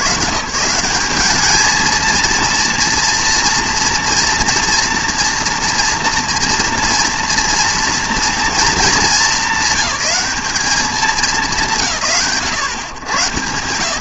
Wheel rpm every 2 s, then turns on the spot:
170, 230, 240, 240, 230, 210, 100.
none